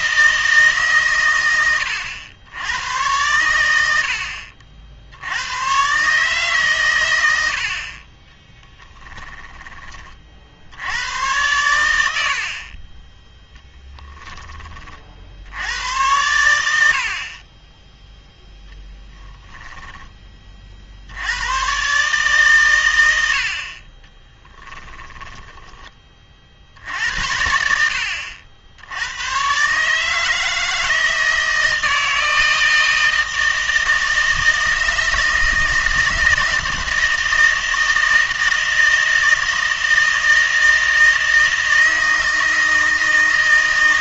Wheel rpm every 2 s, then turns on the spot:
150, 100, 70, 130, 10, 80, 40, 30, 90, 0, 40, 120, 20, 60, 70, 160, 160, 160, 160, 160, 160, 160.
8-10 24-26